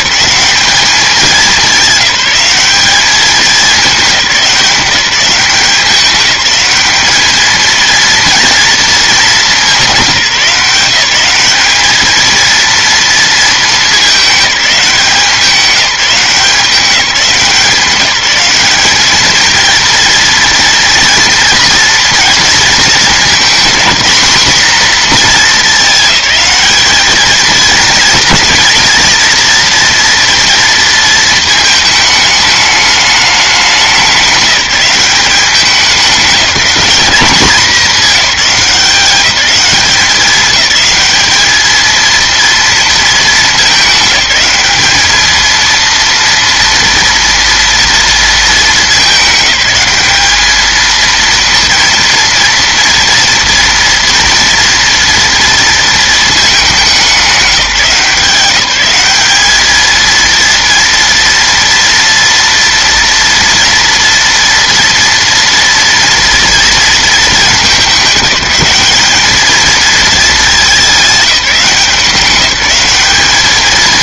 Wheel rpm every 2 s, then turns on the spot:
210, 200, 180, 210, 230, 180, 230, 200, 180, 200, 230, 230, 230, 210, 230, 230, 210, 190, 200, 190, 200, 230, 210, 230, 220, 220, 230, 230, 220, 190, 230, 230, 230, 230, 190, 210, 190.
none